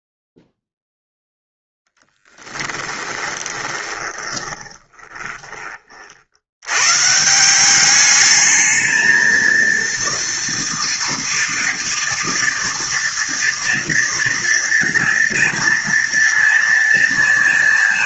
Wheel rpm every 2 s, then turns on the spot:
0, 10, 20, 70, 210, 230, 230, 230, 230.
2-6